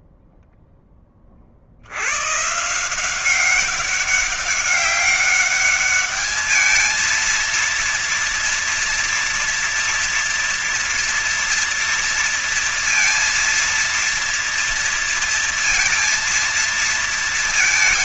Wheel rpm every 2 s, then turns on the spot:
0, 120, 200, 210, 230, 230, 230, 230, 230.
none